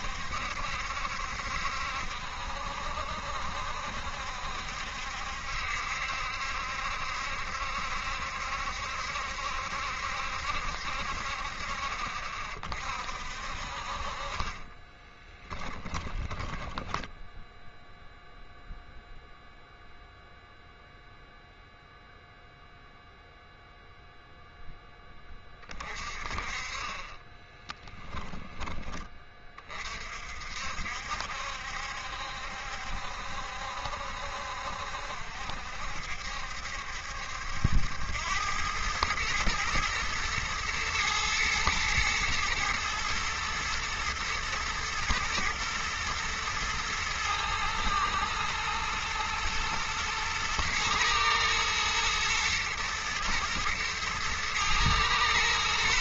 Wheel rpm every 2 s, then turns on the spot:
70, 70, 70, 70, 70, 60, 40, 30, 10, 0, 0, 0, 10, 30, 20, 60, 70, 70, 70, 110, 110, 110, 120, 110, 120, 110, 120, 110.
14-18 26-28